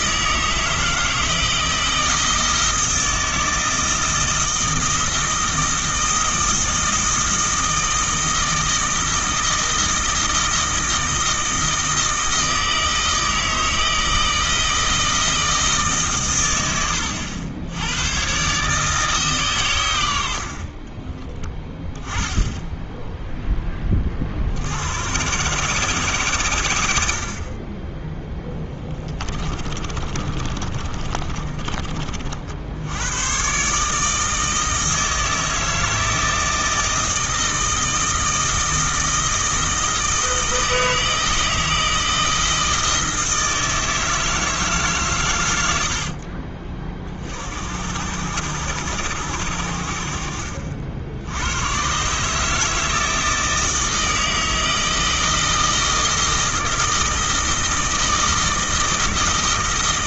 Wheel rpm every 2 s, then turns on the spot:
160, 160, 160, 160, 160, 160, 160, 160, 100, 150, 30, 0, 80, 80, 10, 30, 70, 160, 160, 160, 160, 160, 150, 40, 100, 60, 160, 160, 160, 160.
28-32